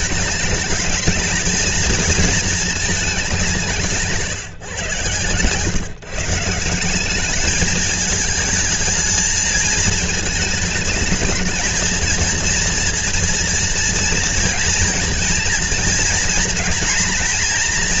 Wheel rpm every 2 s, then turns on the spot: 210, 220, 130, 170, 220, 220, 240, 240, 230.
none